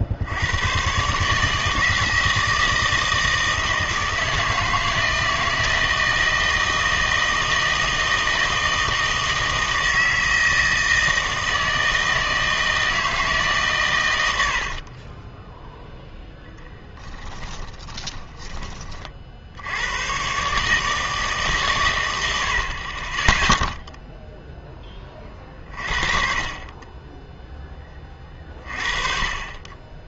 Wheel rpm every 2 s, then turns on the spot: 110, 160, 160, 160, 160, 160, 160, 60, 10, 20, 140, 60, 10, 40, 30.
14-20